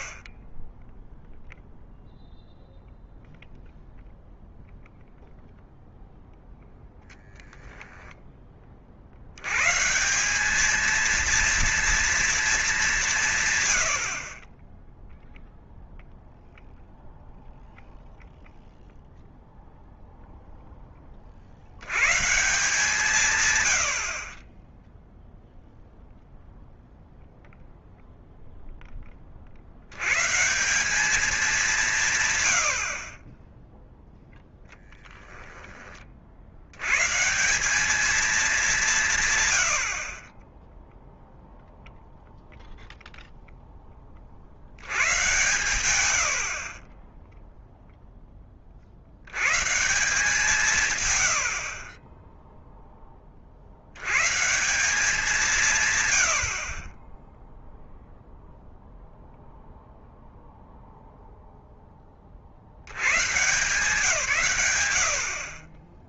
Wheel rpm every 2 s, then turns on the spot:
10, 0, 0, 0, 20, 190, 210, 20, 0, 0, 10, 130, 20, 0, 10, 160, 80, 10, 80, 200, 20, 0, 60, 50, 20, 150, 10, 140, 60, 0, 0, 60, 120.
none